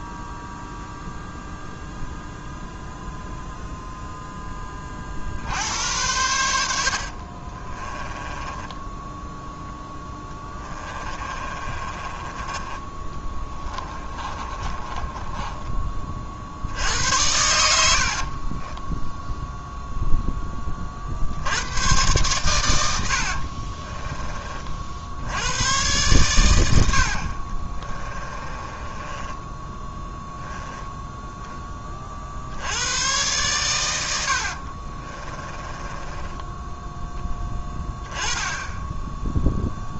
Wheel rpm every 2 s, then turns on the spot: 0, 0, 20, 70, 10, 20, 20, 30, 70, 20, 30, 100, 50, 80, 20, 10, 90, 50, 10, 10.
8-12 14-16 18-20 22-24 28-30 34-36